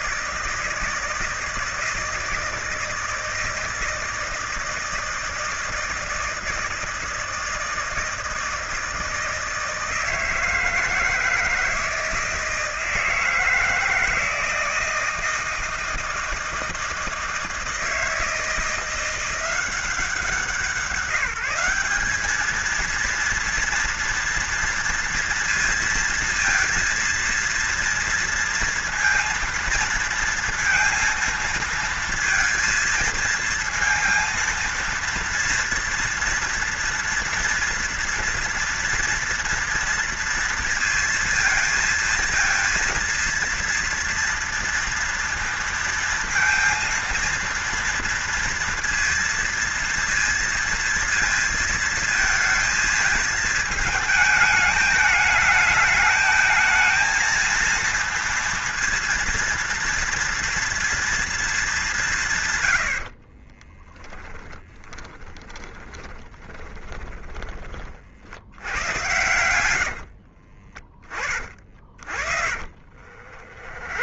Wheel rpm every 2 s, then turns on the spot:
160, 160, 160, 160, 160, 170, 160, 160, 160, 170, 170, 230, 230, 230, 230, 230, 230, 230, 230, 230, 230, 230, 230, 230, 230, 230, 220, 210, 230, 230, 230, 60, 10, 10, 100, 30, 40.
62-70 72-74